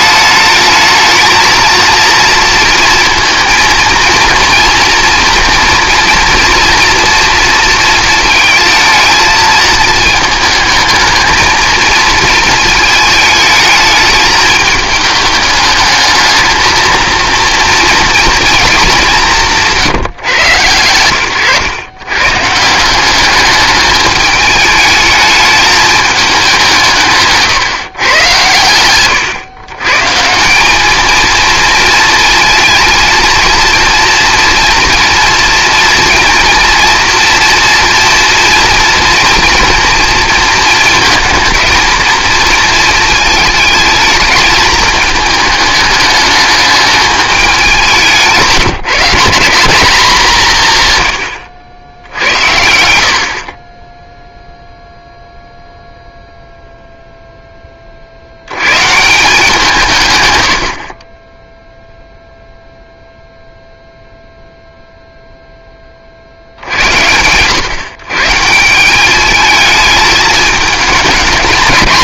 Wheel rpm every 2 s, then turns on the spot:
220, 230, 230, 240, 220, 220, 220, 220, 230, 220, 120, 170, 210, 170, 110, 190, 230, 230, 230, 230, 230, 230, 220, 210, 180, 160, 70, 0, 0, 120, 50, 0, 0, 70, 170, 220.
none